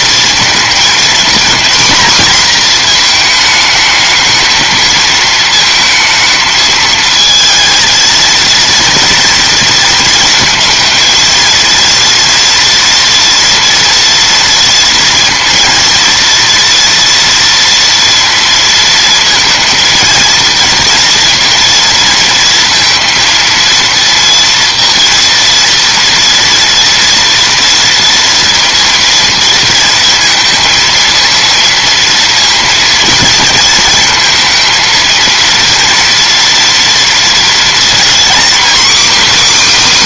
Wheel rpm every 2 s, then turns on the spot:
230, 230, 220, 220, 230, 220, 230, 230, 230, 230, 230, 230, 230, 240, 230, 230, 230, 230, 230, 280.
none